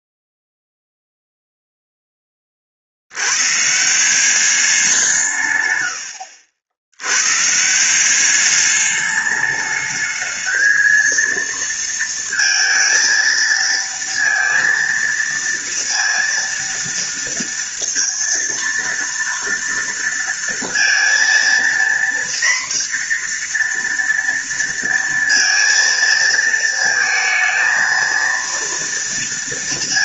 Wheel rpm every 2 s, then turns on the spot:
0, 80, 170, 100, 210, 230, 230, 230, 230, 230, 230, 240, 230, 230, 230.
none